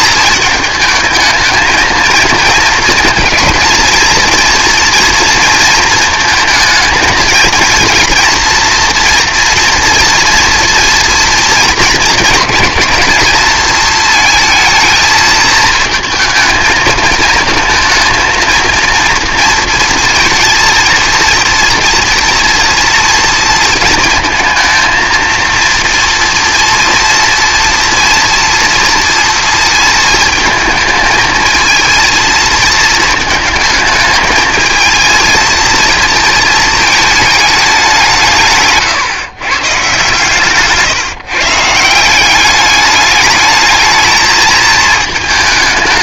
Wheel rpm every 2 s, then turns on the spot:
220, 230, 230, 220, 230, 230, 220, 220, 220, 230, 230, 230, 220, 230, 240, 220, 220, 220, 220, 140, 140, 200, 220.
40-42